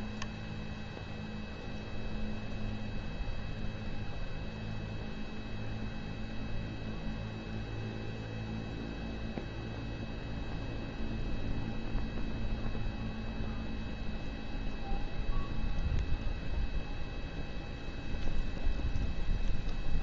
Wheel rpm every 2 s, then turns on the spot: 0, 0, 0, 0, 0, 0, 0, 0, 0, 0.
none